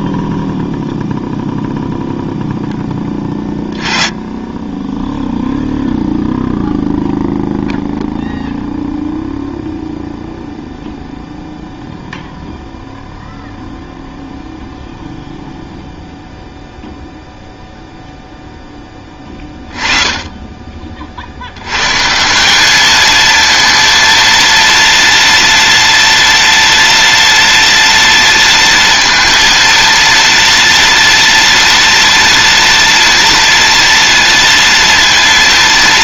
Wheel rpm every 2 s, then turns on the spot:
0, 10, 10, 0, 0, 0, 0, 0, 0, 10, 30, 210, 230, 230, 230, 230, 230, 230.
none